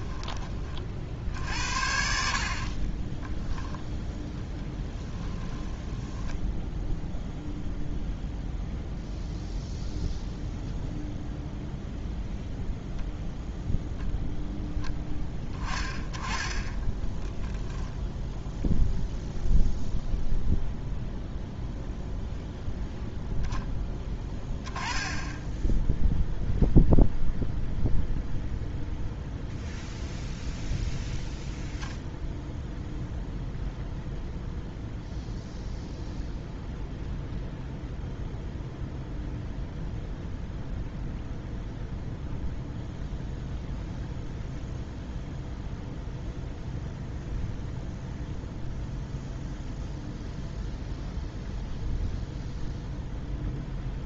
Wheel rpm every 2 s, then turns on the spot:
40, 50, 10, 0, 0, 0, 0, 10, 10, 0, 0, 0, 10, 0, 0, 0, 0, 0, 0, 0, 0, 0, 0, 0, 0, 0, 0.
2-6